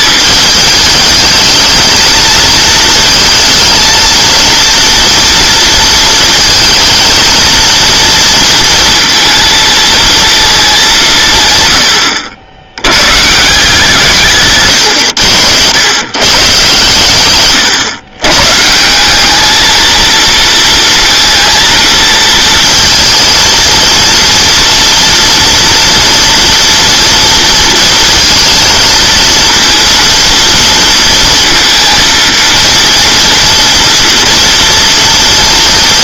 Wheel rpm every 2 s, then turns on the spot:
220, 220, 230, 220, 230, 220, 90, 140, 140, 150, 230, 230, 240, 230, 230, 230, 230, 230.
none